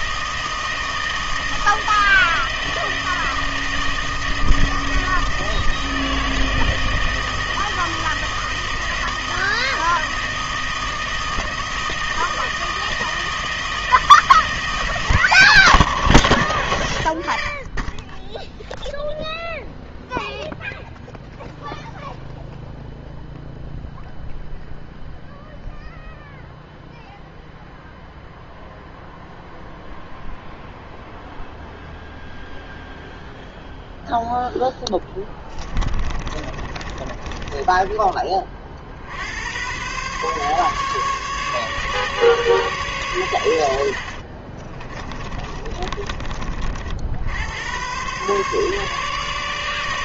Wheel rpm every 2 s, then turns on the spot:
160, 160, 160, 160, 160, 160, 160, 160, 100, 0, 0, 0, 0, 0, 0, 0, 0, 0, 30, 40, 140, 130, 30, 50, 140.
36-38 44-46